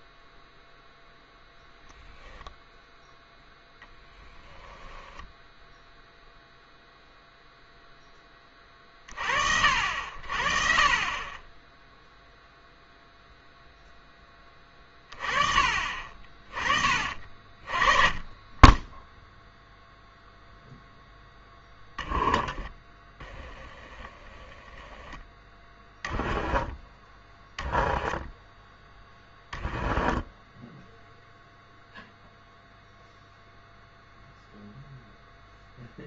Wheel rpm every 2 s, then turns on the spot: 0, 0, 10, 0, 30, 40, 0, 20, 30, 10, 0, 20, 10, 20, 10, 10, 0, 0.
4-6 22-24 26-32